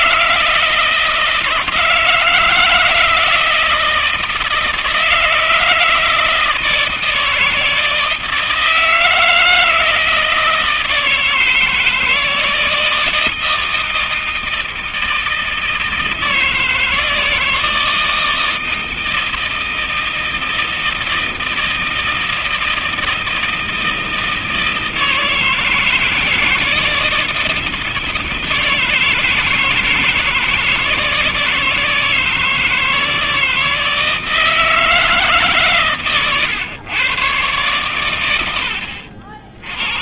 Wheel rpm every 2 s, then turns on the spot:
160, 160, 160, 160, 160, 160, 160, 160, 160, 160, 160, 160, 160, 160, 160, 160, 160, 160, 140, 90.
none